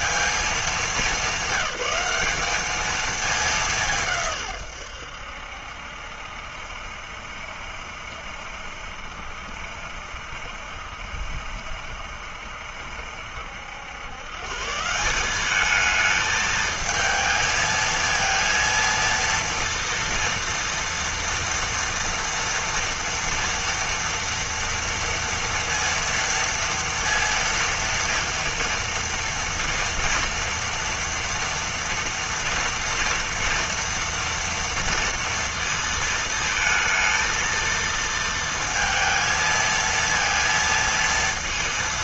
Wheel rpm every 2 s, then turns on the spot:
210, 210, 110, 70, 70, 60, 70, 150, 220, 230, 230, 230, 230, 230, 230, 230, 230, 230, 220, 230, 230.
none